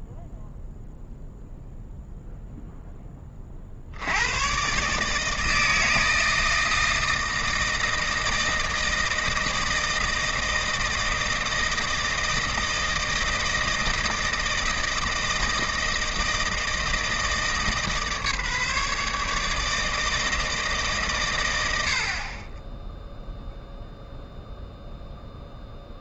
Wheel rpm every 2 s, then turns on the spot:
0, 0, 130, 160, 160, 160, 160, 160, 160, 150, 150, 10, 0.
none